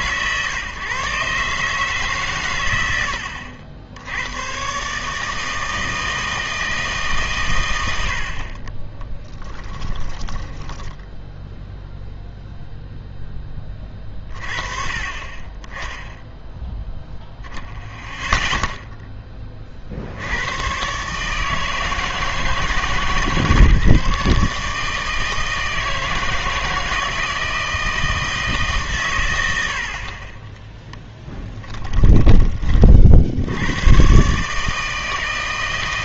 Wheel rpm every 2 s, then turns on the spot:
130, 120, 120, 160, 40, 10, 0, 30, 0, 0, 110, 160, 150, 160, 150, 10, 30, 150.
10-12